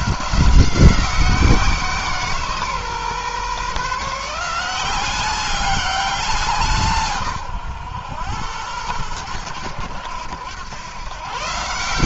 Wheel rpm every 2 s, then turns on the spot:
180, 140, 180, 160, 100, 120.
none